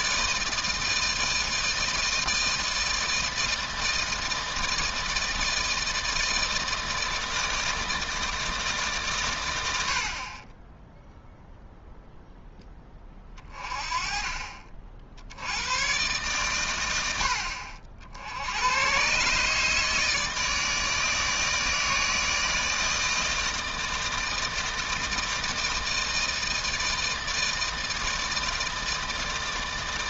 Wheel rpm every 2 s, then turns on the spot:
160, 160, 160, 160, 140, 10, 20, 60, 100, 110, 160, 160, 160, 160, 160.
none